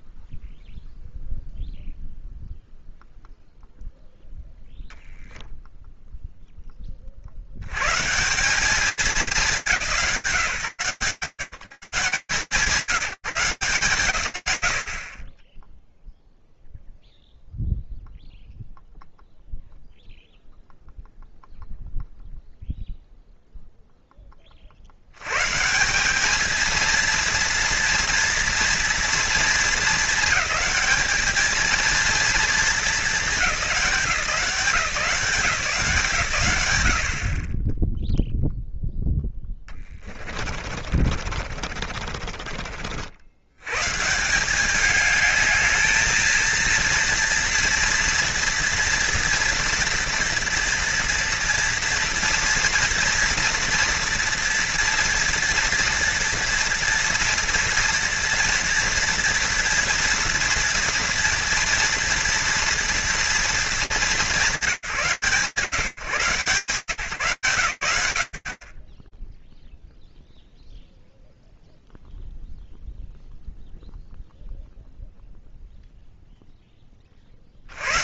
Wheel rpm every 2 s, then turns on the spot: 0, 0, 0, 0, 170, 150, 150, 140, 0, 0, 0, 0, 60, 230, 230, 210, 230, 170, 90, 0, 50, 60, 200, 230, 230, 230, 230, 240, 230, 230, 230, 230, 170, 140, 40, 0, 0, 0, 20.
40-42